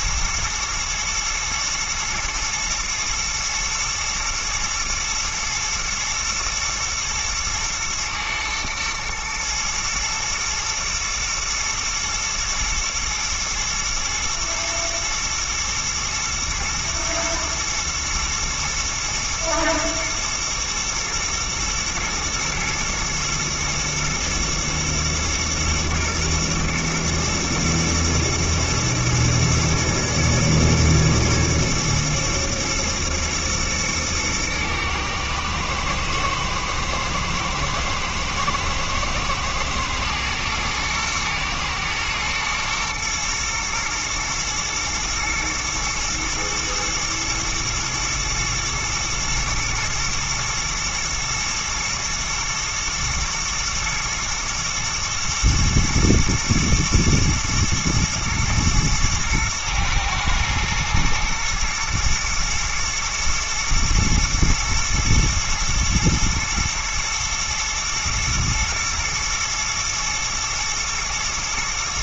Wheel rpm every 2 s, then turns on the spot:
110, 120, 120, 110, 110, 110, 110, 120, 110, 120, 110, 110, 110, 120, 110, 110, 120, 110, 120, 110, 120, 110, 110, 110, 120, 120, 120, 110, 110, 110, 110, 120, 110, 110, 120, 110.
none